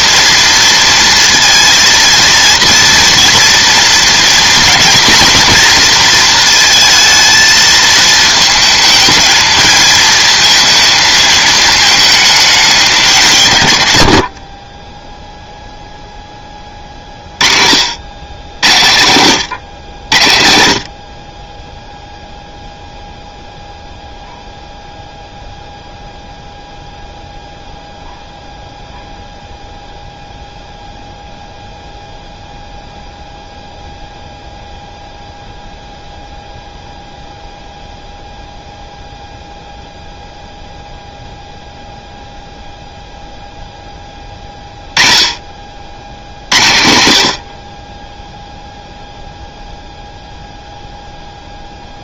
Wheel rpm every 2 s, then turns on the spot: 230, 230, 240, 230, 220, 230, 200, 20, 30, 100, 60, 0, 0, 0, 0, 0, 0, 0, 0, 0, 0, 0, 20, 80, 0, 0.
none